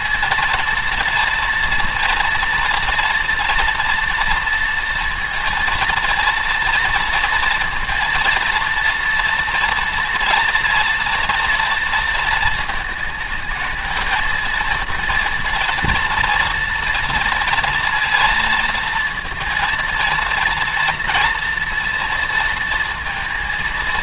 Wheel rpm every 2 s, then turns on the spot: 230, 230, 230, 230, 230, 240, 230, 230, 230, 230, 230, 230.
none